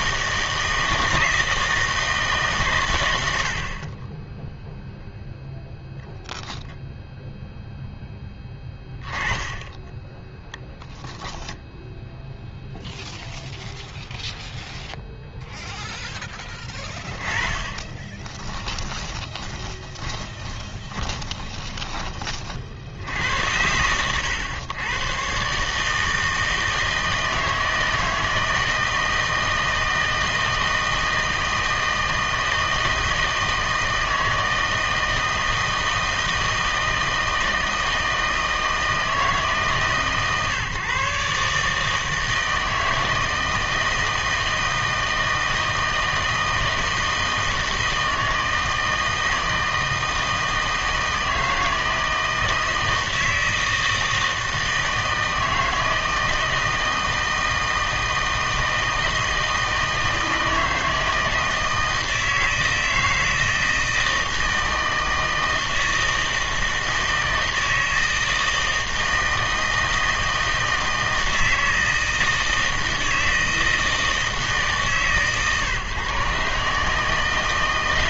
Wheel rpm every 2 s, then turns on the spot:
160, 140, 0, 10, 10, 10, 0, 0, 10, 10, 20, 50, 100, 160, 160, 160, 160, 160, 160, 160, 140, 160, 160, 160, 160, 160, 160, 160, 160, 160, 160, 160, 160, 160, 160, 160, 160, 150, 140.
18-22